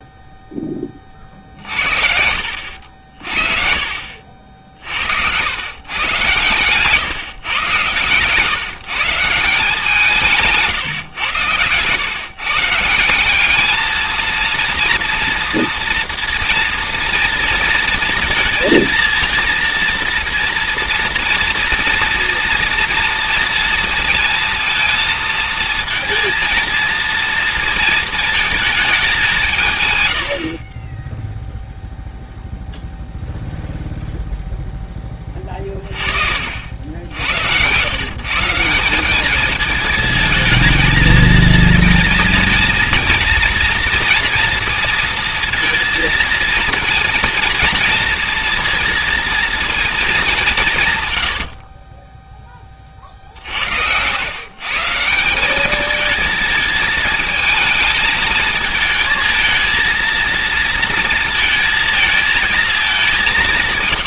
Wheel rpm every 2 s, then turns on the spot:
10, 60, 60, 120, 150, 160, 150, 230, 240, 230, 230, 240, 230, 230, 220, 40, 0, 0, 60, 160, 220, 230, 230, 230, 230, 170, 20, 130, 220, 220, 230, 220.
10-12